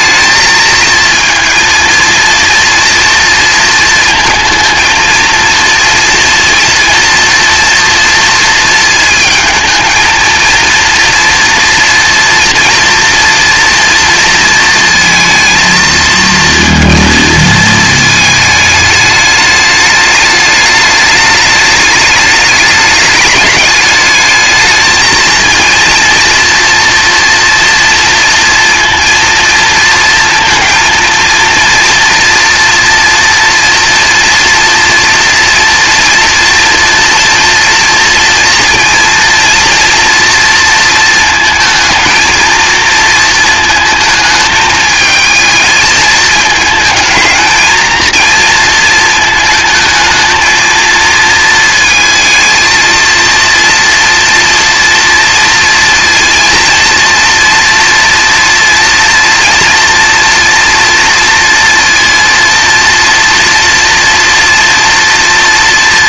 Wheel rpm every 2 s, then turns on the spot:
220, 230, 230, 230, 220, 230, 230, 230, 230, 210, 210, 210, 220, 230, 230, 230, 230, 230, 230, 230, 230, 220, 220, 220, 230, 230, 230, 230, 230, 230, 230, 230, 240.
none